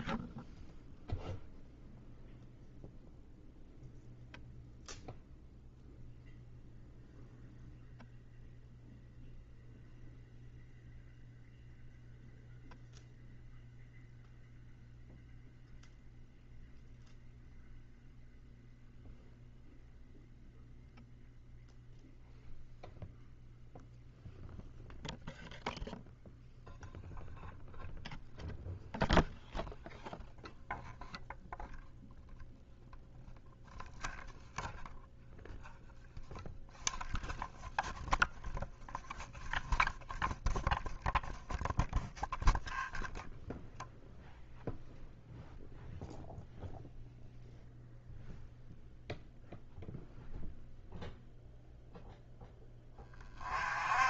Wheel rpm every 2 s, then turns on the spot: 0, 0, 0, 0, 0, 0, 0, 0, 0, 0, 0, 0, 0, 0, 0, 0, 0, 0, 0, 0, 0, 0, 0, 0, 0, 0, 20.
none